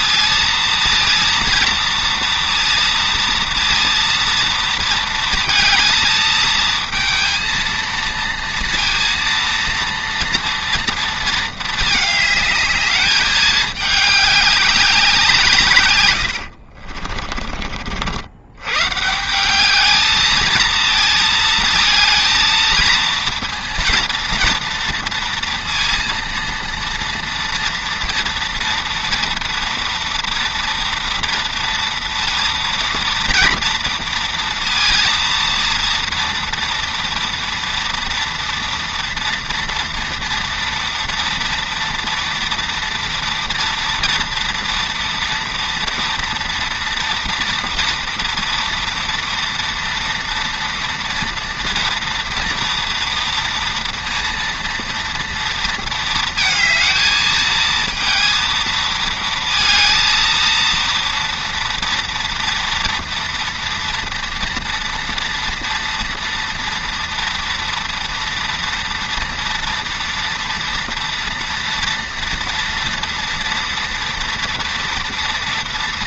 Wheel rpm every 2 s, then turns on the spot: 230, 230, 230, 220, 230, 230, 210, 200, 70, 110, 220, 230, 230, 230, 230, 230, 230, 230, 230, 230, 230, 230, 230, 230, 230, 230, 230, 230, 220, 230, 230, 230, 230, 230, 230, 240, 230, 230.
16-18